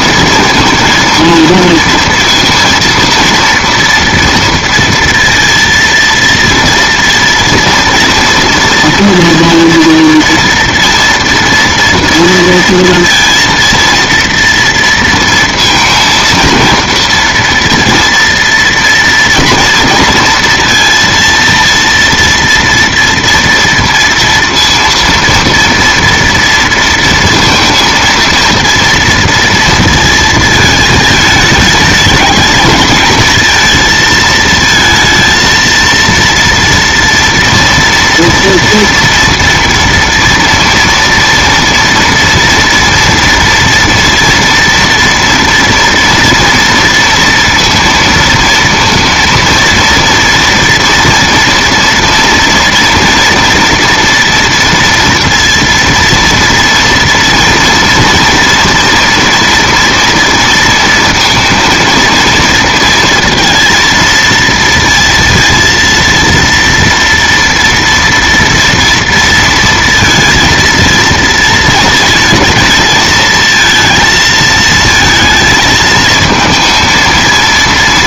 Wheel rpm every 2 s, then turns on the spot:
230, 230, 230, 230, 230, 230, 230, 230, 230, 230, 230, 230, 230, 230, 230, 220, 220, 220, 230, 230, 230, 240, 230, 230, 230, 230, 230, 230, 230, 230, 230, 230, 230, 230, 230, 230, 220, 220, 220.
none